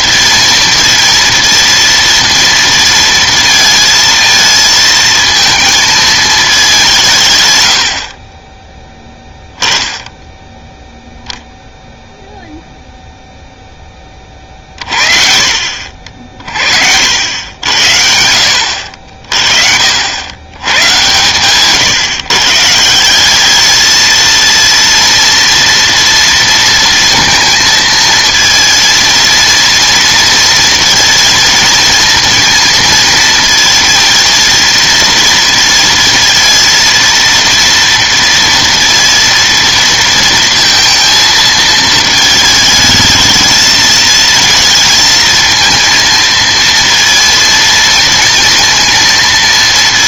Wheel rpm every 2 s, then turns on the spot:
230, 230, 220, 200, 20, 0, 0, 40, 40, 70, 110, 150, 230, 230, 230, 230, 230, 230, 230, 230, 230, 220, 230, 230, 230.
none